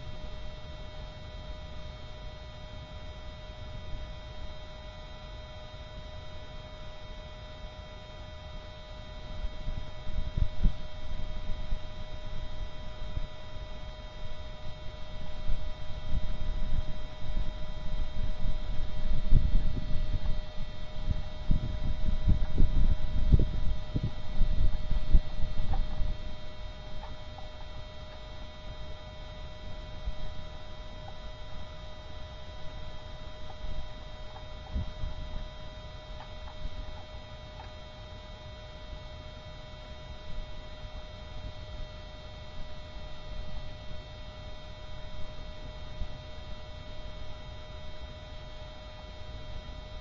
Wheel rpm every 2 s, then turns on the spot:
0, 0, 0, 0, 0, 0, 0, 0, 0, 0, 0, 0, 0, 0, 0, 0, 0, 0, 0, 0, 0, 0, 0, 0, 0.
none